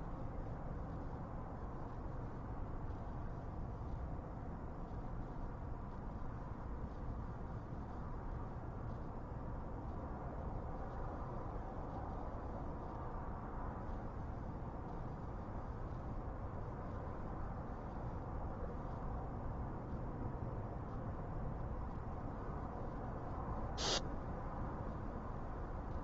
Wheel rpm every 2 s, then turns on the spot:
0, 0, 0, 0, 0, 0, 0, 0, 0, 0, 0, 0, 0.
none